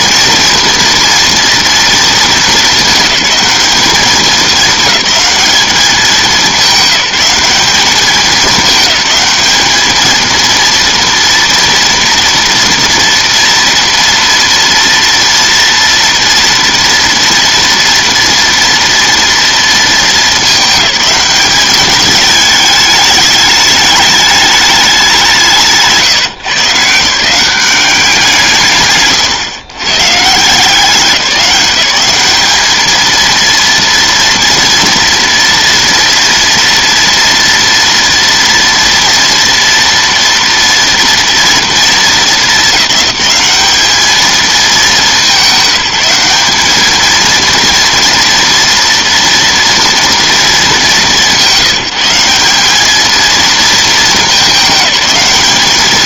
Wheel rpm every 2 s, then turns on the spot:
230, 220, 210, 200, 210, 230, 230, 230, 240, 230, 210, 210, 210, 140, 160, 170, 220, 230, 230, 230, 230, 200, 210, 210, 230, 210, 200, 210.
none